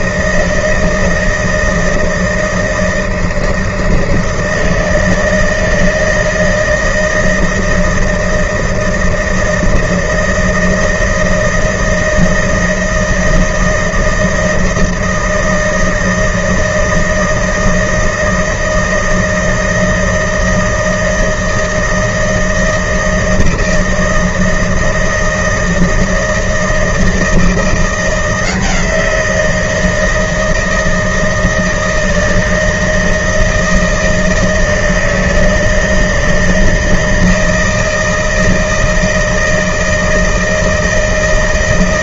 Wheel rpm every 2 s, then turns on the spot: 160, 160, 160, 160, 160, 160, 160, 160, 160, 160, 160, 170, 160, 160, 170, 160, 160, 160, 160, 160, 160.
none